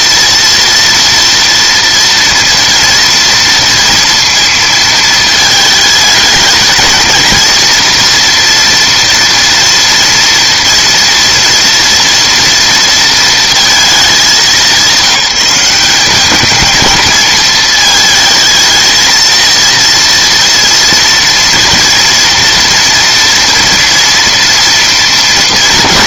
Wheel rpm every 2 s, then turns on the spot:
230, 240, 220, 220, 230, 230, 230, 190, 220, 220, 230, 240, 230.
none